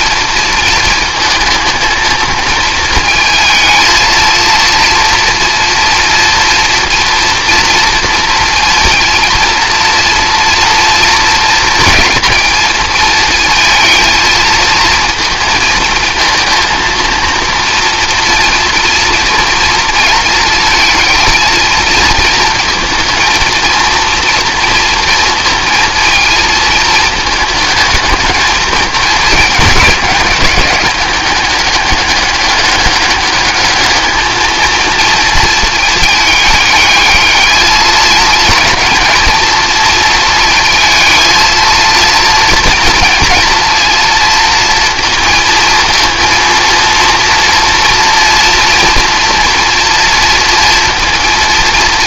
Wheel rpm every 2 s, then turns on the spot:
230, 230, 230, 240, 230, 230, 230, 220, 230, 230, 220, 230, 230, 220, 210, 200, 200, 220, 210, 230, 230, 230, 230, 230, 230, 230.
none